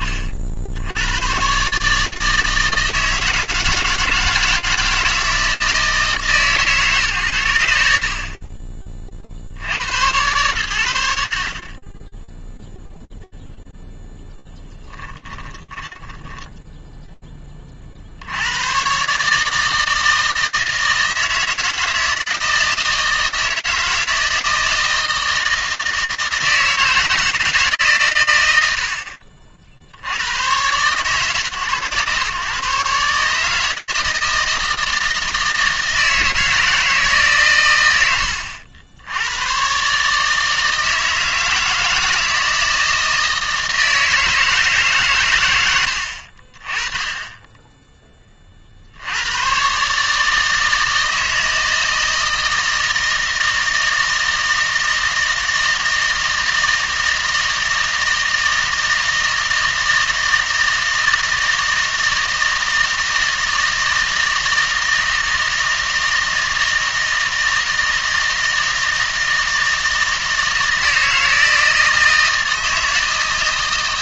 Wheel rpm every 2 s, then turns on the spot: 20, 150, 160, 150, 50, 100, 10, 0, 10, 70, 160, 160, 160, 160, 120, 110, 120, 160, 160, 80, 150, 160, 160, 40, 40, 160, 160, 160, 160, 160, 160, 160, 160, 160, 160, 160, 160.
16-18